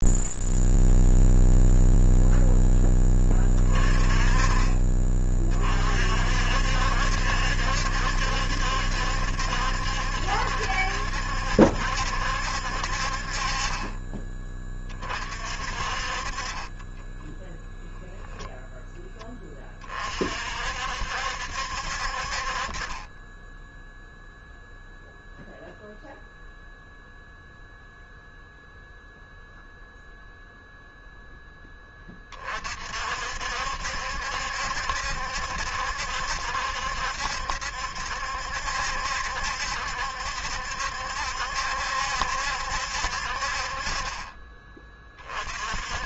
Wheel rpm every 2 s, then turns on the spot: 0, 0, 30, 50, 70, 70, 70, 20, 30, 0, 50, 50, 0, 0, 0, 0, 30, 70, 70, 70, 70, 70, 30.
none